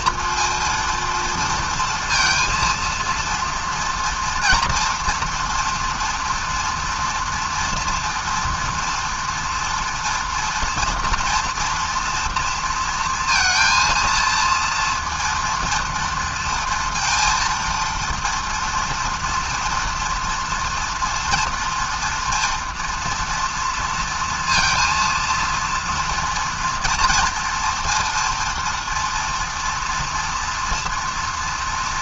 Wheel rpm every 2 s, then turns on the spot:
230, 230, 230, 230, 230, 230, 230, 230, 230, 230, 230, 240, 230, 230, 230, 230.
none